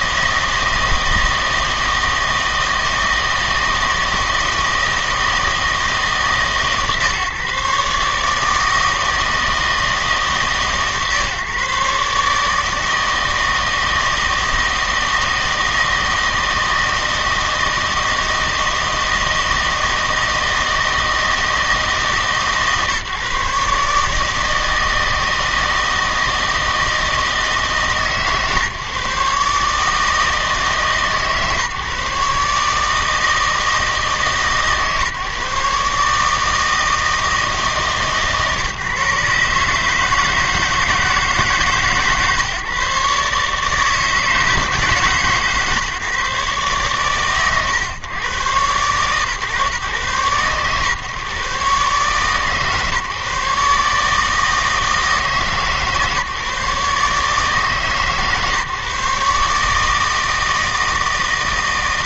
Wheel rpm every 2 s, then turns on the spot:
160, 160, 160, 140, 160, 140, 150, 160, 160, 160, 160, 150, 160, 160, 140, 150, 150, 140, 160, 150, 160, 140, 160, 140, 120, 130, 140, 160, 140, 140, 160.
none